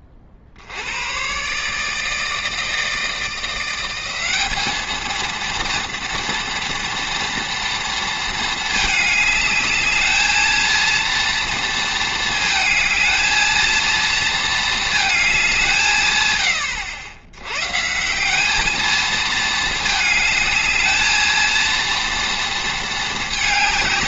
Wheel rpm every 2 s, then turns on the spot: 70, 160, 210, 230, 220, 230, 220, 220, 80, 210, 220, 220.
none